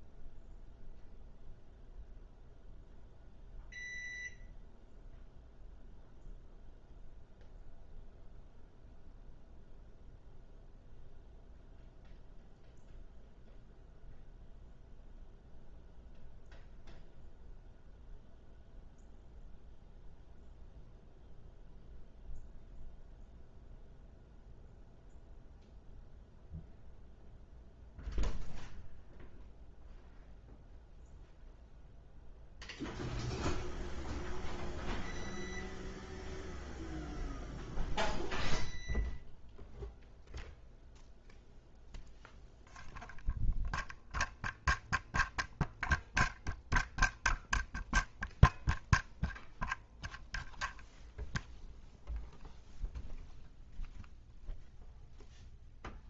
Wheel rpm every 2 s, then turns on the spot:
0, 0, 0, 0, 0, 0, 0, 0, 0, 0, 0, 0, 0, 0, 0, 0, 0, 0, 0, 0, 0, 0, 0, 0, 0, 0, 0, 0.
none